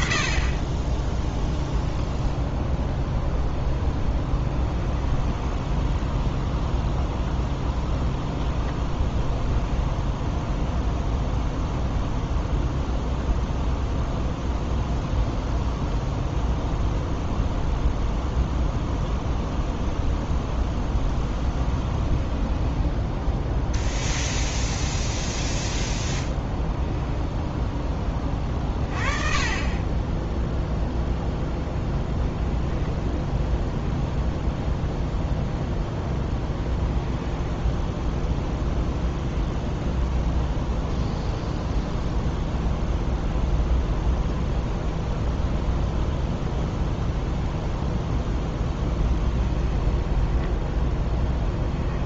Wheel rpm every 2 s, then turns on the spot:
30, 0, 10, 0, 0, 0, 0, 0, 0, 0, 10, 10, 0, 10, 30, 0, 10, 0, 0, 0, 0, 0, 10, 0, 0, 10.
4-6 22-24 32-34 50-52